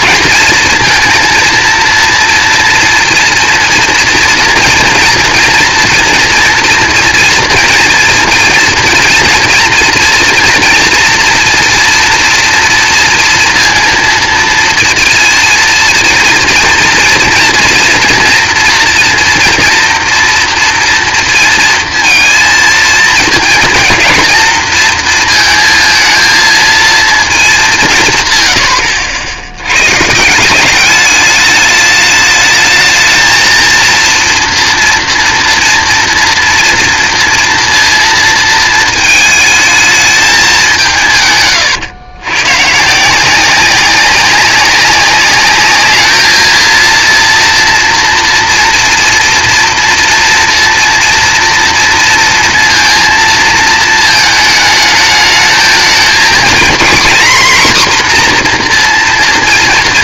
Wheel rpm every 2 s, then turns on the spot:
230, 230, 240, 230, 230, 230, 230, 230, 240, 240, 230, 230, 230, 220, 80, 210, 230, 230, 230, 220, 150, 170, 200, 230, 230, 230, 230, 220, 260, 230.
none